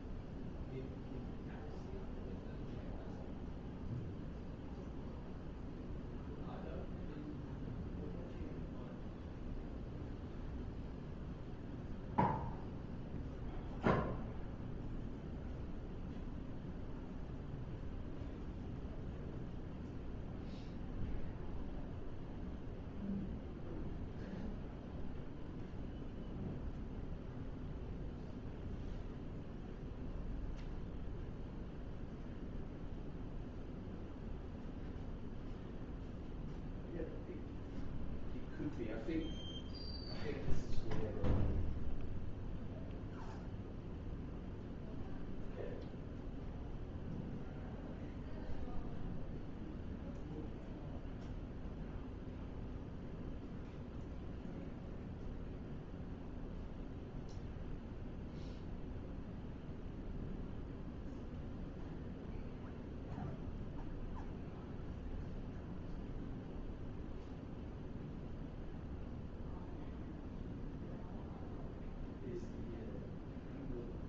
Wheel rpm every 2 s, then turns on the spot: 0, 0, 0, 0, 0, 0, 0, 0, 0, 0, 0, 0, 0, 0, 0, 0, 0, 0, 0, 0, 0, 0, 0, 0, 0, 0, 0, 0, 0, 0, 0, 0, 0, 0, 0, 0, 0.
none